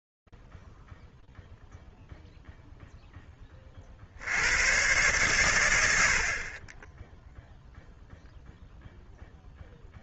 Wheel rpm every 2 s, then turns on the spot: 0, 0, 90, 40, 0.
none